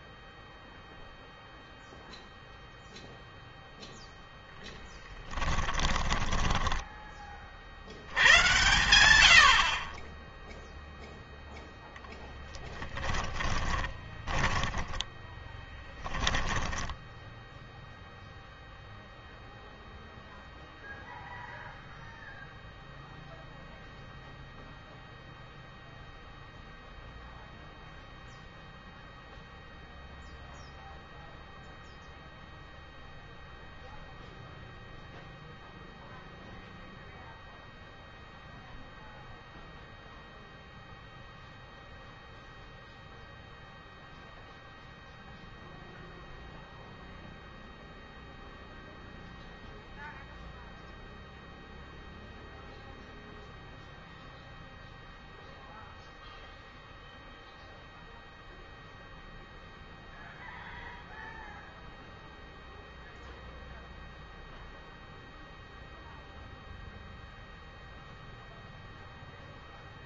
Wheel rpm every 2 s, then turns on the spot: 0, 0, 10, 10, 110, 0, 10, 10, 10, 0, 0, 0, 0, 0, 0, 0, 0, 0, 0, 0, 0, 0, 0, 0, 0, 0, 0, 0, 0, 0, 0, 0, 0, 0, 0.
4-8 12-18